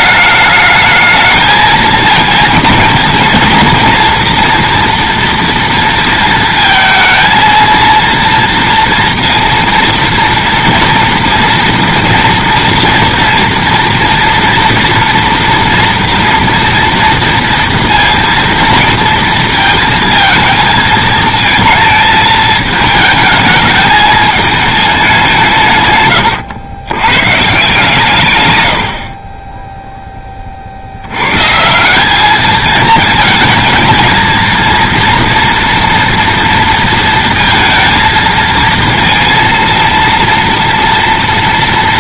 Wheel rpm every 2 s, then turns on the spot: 210, 230, 230, 220, 230, 230, 230, 240, 230, 230, 220, 220, 220, 110, 100, 40, 210, 230, 230, 230, 230.
none